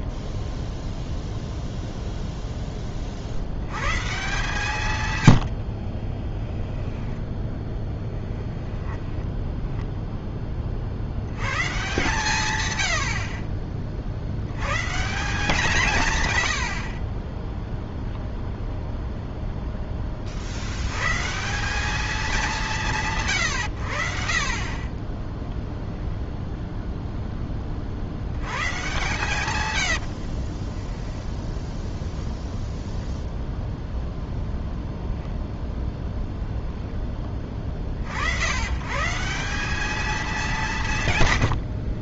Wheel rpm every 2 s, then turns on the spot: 0, 10, 150, 10, 10, 20, 110, 90, 100, 0, 70, 190, 30, 0, 110, 40, 0, 0, 0, 100, 200.
6-10 30-32